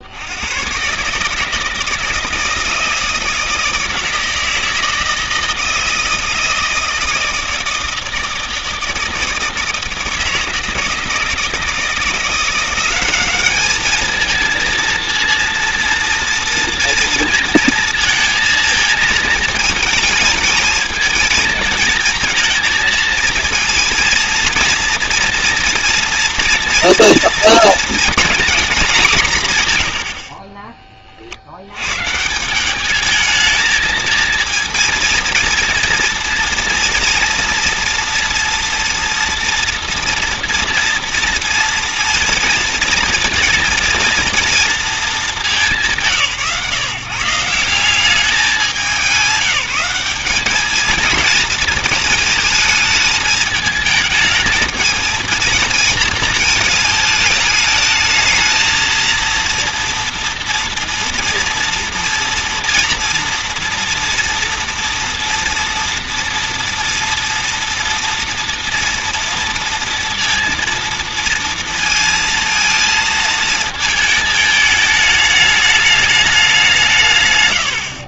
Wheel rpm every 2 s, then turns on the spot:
110, 160, 160, 160, 160, 160, 180, 220, 230, 230, 230, 230, 230, 240, 240, 40, 190, 230, 230, 230, 240, 230, 230, 150, 200, 210, 220, 220, 220, 220, 230, 230, 240, 230, 230, 230, 230, 220, 190.
none